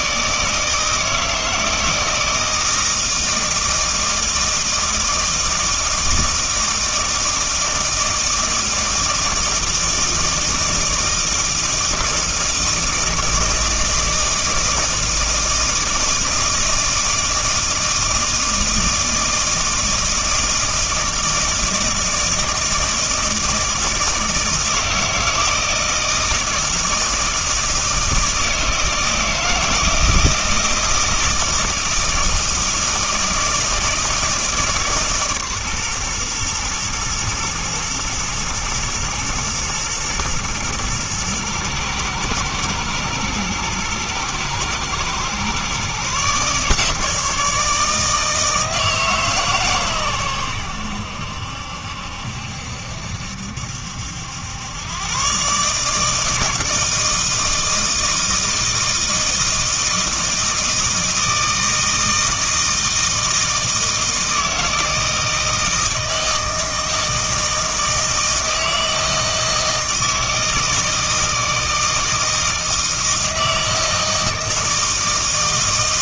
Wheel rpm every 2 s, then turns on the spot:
160, 160, 160, 160, 160, 160, 160, 160, 160, 160, 160, 160, 160, 160, 160, 160, 160, 150, 120, 110, 110, 110, 120, 150, 160, 90, 70, 100, 160, 160, 160, 160, 160, 160, 160, 160, 160, 160.
none